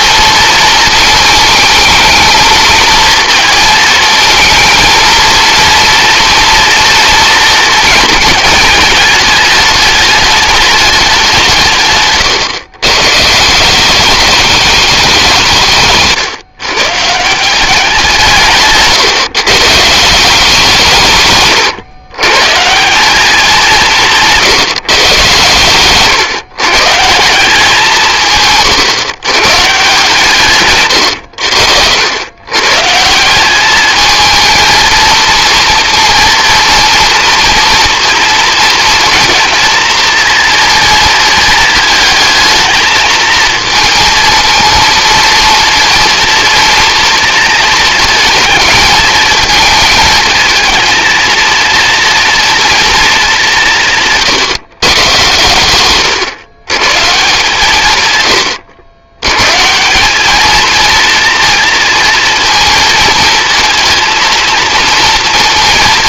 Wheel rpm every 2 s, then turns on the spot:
220, 220, 230, 240, 220, 210, 130, 210, 140, 160, 180, 170, 150, 140, 130, 120, 140, 230, 230, 230, 230, 220, 230, 240, 220, 220, 230, 140, 130, 100, 230, 230, 230.
none